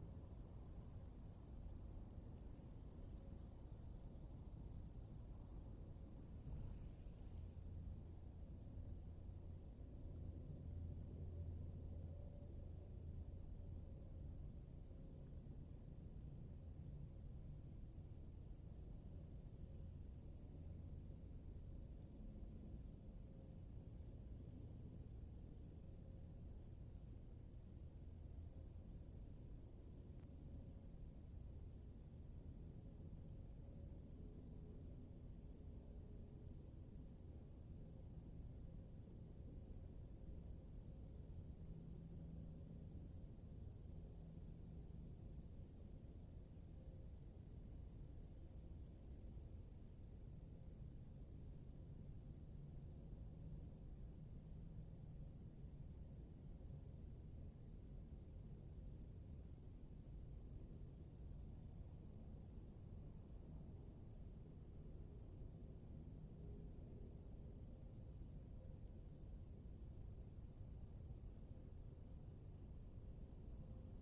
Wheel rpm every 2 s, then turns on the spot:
0, 0, 0, 0, 0, 0, 0, 0, 0, 0, 0, 0, 0, 0, 0, 0, 0, 0, 0, 0, 0, 0, 0, 0, 0, 0, 0, 0, 0, 0, 0, 0, 0, 0, 0, 0, 0.
none